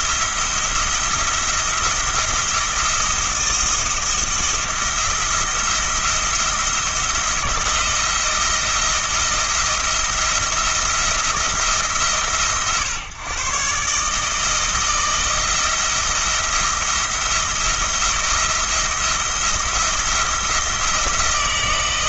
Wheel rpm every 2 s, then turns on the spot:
170, 170, 170, 160, 170, 170, 130, 160, 170, 170, 170.
none